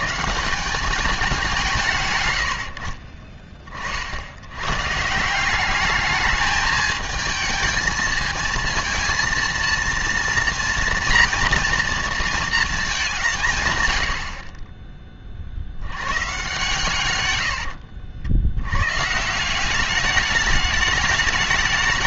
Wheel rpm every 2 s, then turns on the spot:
180, 70, 100, 220, 230, 230, 220, 40, 130, 90, 210.
2-4